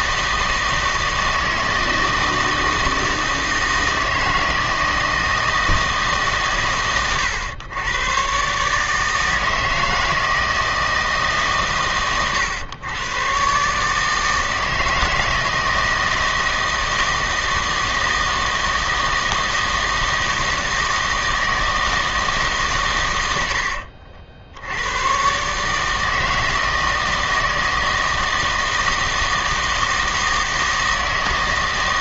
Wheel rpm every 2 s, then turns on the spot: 160, 160, 160, 140, 130, 160, 110, 160, 160, 160, 160, 140, 80, 160, 160, 160.
none